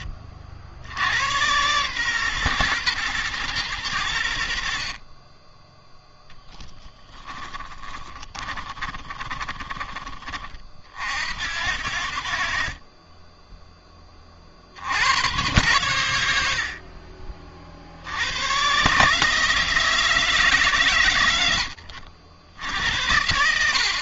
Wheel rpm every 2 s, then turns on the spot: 100, 120, 60, 10, 30, 50, 30, 80, 50, 130, 120, 80.
6-10 16-18